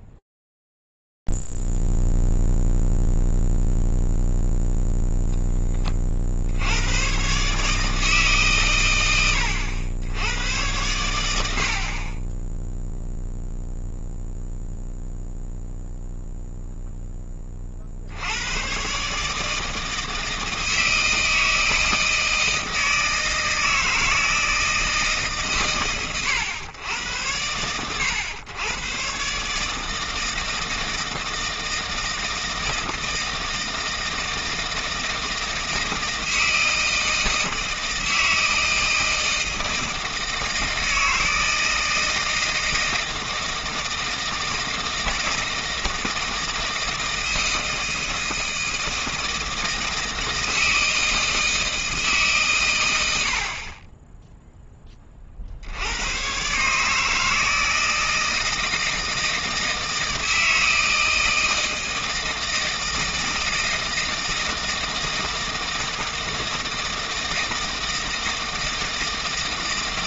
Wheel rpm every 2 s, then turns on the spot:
0, 0, 0, 50, 150, 100, 30, 0, 0, 100, 160, 160, 160, 110, 110, 160, 160, 160, 160, 160, 160, 160, 160, 160, 160, 160, 100, 20, 150, 160, 160, 160, 160, 160, 160.
none